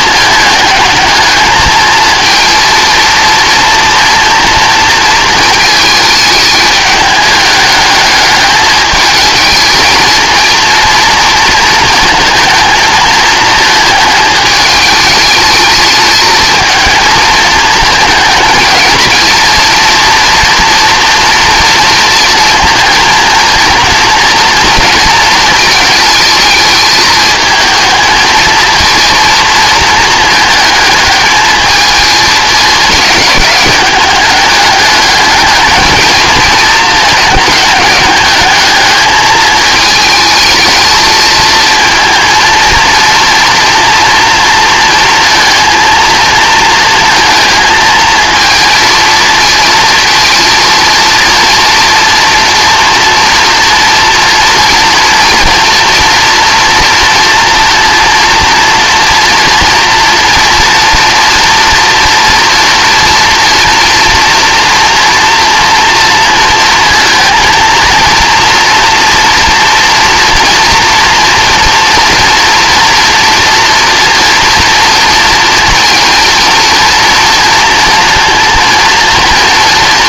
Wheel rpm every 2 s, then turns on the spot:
210, 230, 230, 210, 210, 230, 220, 210, 230, 230, 230, 230, 230, 220, 230, 210, 210, 210, 220, 210, 220, 230, 230, 220, 230, 230, 240, 240, 230, 230, 240, 230, 230, 230, 230, 230, 230, 230, 230, 230.
none